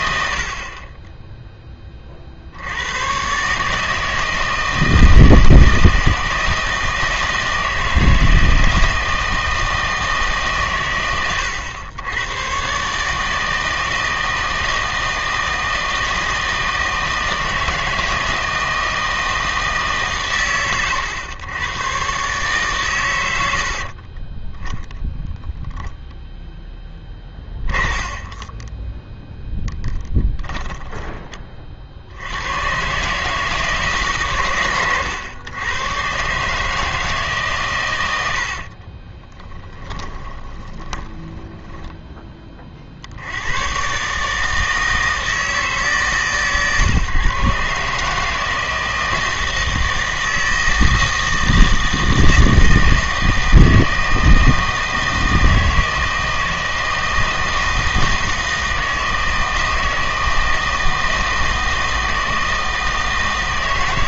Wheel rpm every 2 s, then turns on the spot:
40, 70, 160, 160, 160, 130, 130, 160, 160, 160, 110, 140, 10, 10, 20, 10, 110, 120, 150, 60, 20, 40, 160, 130, 160, 160, 160, 160, 160, 160, 160, 160.
26-32 38-42